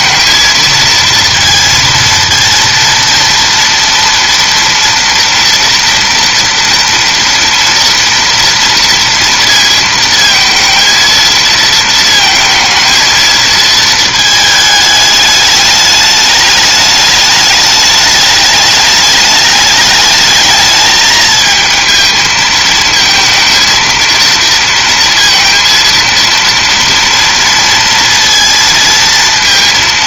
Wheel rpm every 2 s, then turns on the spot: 230, 230, 230, 230, 230, 230, 230, 220, 210, 210, 220, 220, 230, 230, 230.
none